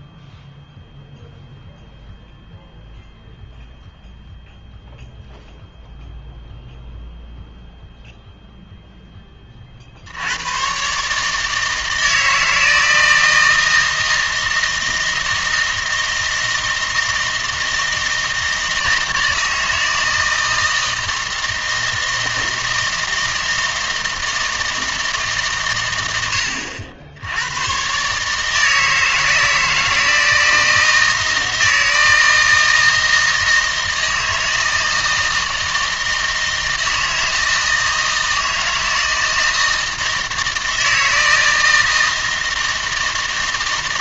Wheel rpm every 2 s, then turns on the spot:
0, 0, 0, 0, 0, 110, 160, 160, 160, 160, 160, 160, 160, 80, 160, 160, 160, 160, 160, 160, 160, 160.
none